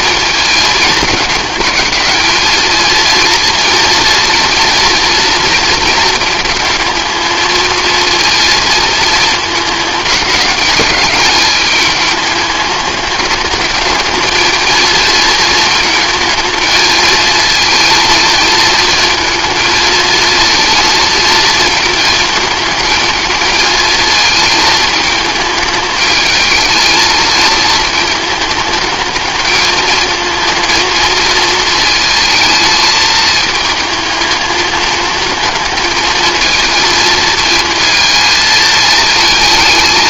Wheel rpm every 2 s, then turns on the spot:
210, 220, 230, 220, 220, 210, 210, 220, 220, 220, 230, 220, 220, 220, 210, 220, 220, 220, 230, 220.
none